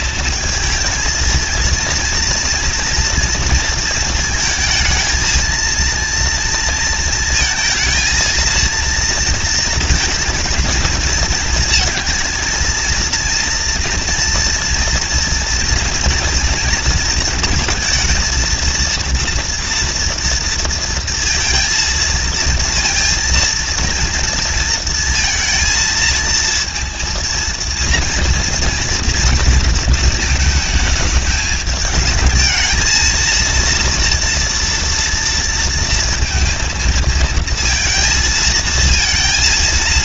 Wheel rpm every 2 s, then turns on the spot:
220, 230, 220, 230, 220, 230, 220, 230, 230, 230, 230, 230, 230, 230, 230, 220, 220, 230, 220, 220.
none